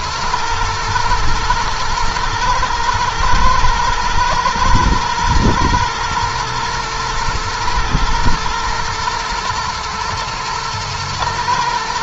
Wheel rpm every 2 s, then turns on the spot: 110, 110, 110, 110, 110, 110.
none